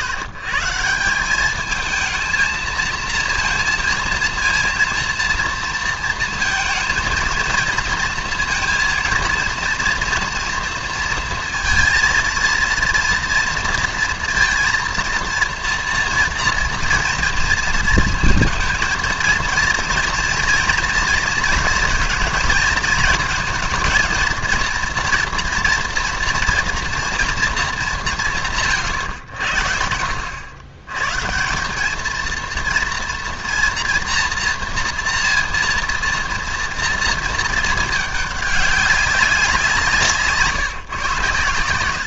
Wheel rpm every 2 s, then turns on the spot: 160, 220, 230, 230, 230, 230, 230, 230, 230, 230, 230, 230, 230, 230, 160, 110, 230, 230, 230, 200, 150.
none